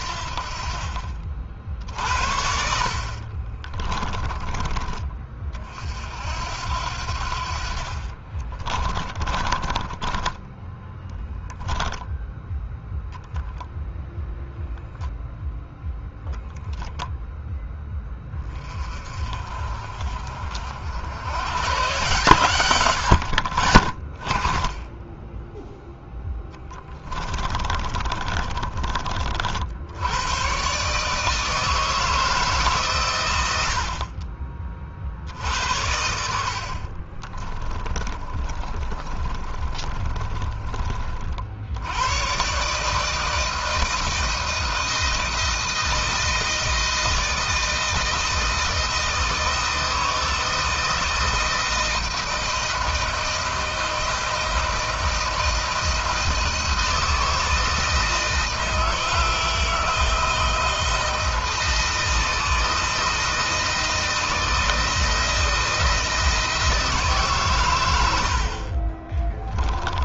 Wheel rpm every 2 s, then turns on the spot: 50, 70, 30, 70, 30, 10, 0, 0, 0, 30, 70, 120, 10, 10, 30, 130, 140, 40, 60, 30, 40, 140, 160, 160, 160, 160, 160, 160, 160, 160, 160, 160, 170, 160, 40.
2-4 8-12 26-28 38-40 68-70